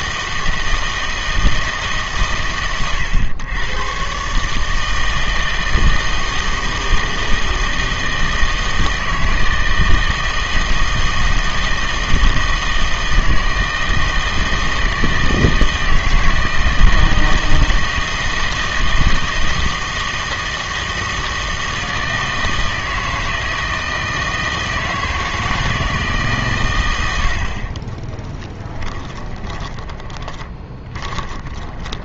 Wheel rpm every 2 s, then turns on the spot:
160, 120, 150, 160, 160, 160, 160, 160, 160, 160, 160, 160, 160, 120, 10, 20.
28-32